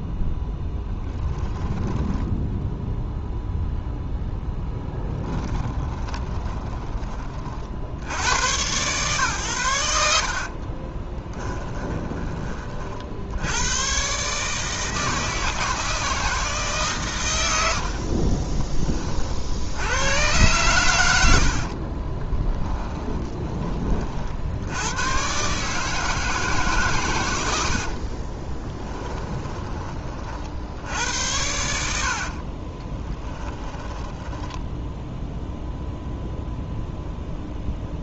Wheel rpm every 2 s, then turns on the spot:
10, 0, 10, 20, 120, 30, 40, 160, 140, 20, 100, 20, 90, 140, 20, 80, 20, 0, 0.
4-6 10-12 22-24 28-30 32-34